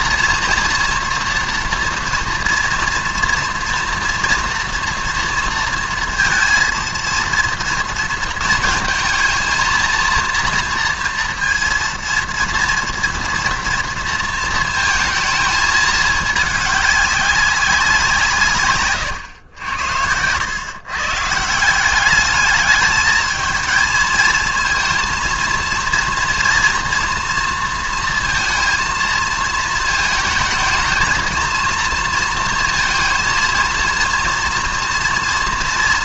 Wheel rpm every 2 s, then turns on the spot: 230, 230, 230, 230, 230, 230, 230, 230, 200, 140, 130, 210, 230, 230, 230, 220, 230, 230.
none